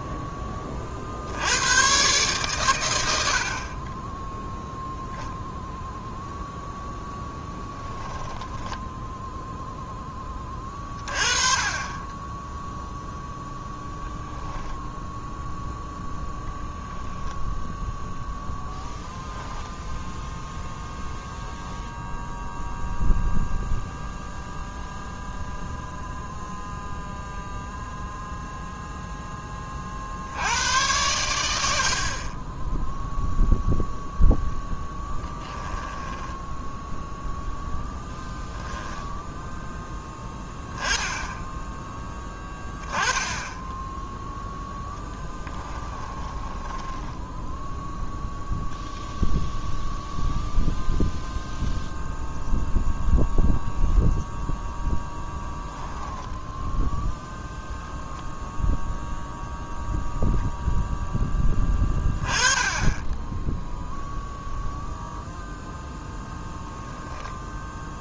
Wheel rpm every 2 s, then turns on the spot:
30, 110, 0, 0, 10, 20, 0, 0, 0, 0, 0, 0, 0, 0, 0, 100, 0, 10, 10, 0, 10, 20, 0, 10, 0, 0, 0, 10, 10, 0, 0, 20, 0, 0.
8-10 36-38 46-48